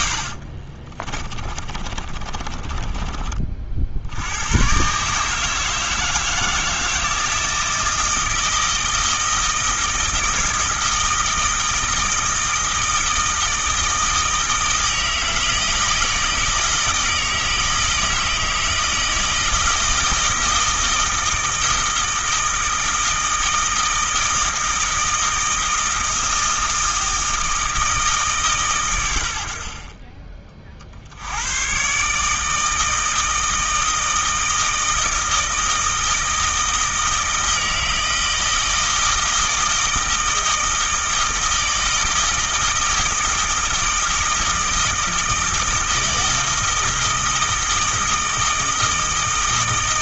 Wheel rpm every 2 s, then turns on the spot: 30, 30, 130, 160, 160, 160, 160, 160, 160, 160, 160, 160, 160, 160, 110, 60, 160, 160, 160, 160, 160, 160, 160, 160, 160.
0-4